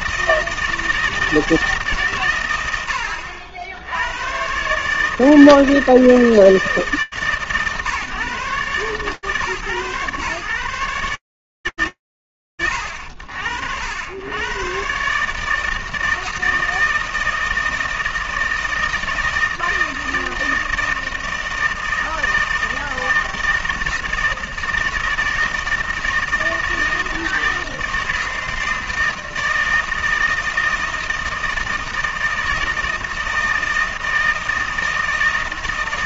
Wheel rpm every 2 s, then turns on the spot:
160, 130, 80, 160, 140, 130, 80, 130, 160, 160, 160, 160, 160, 160, 160, 160, 160, 160.
none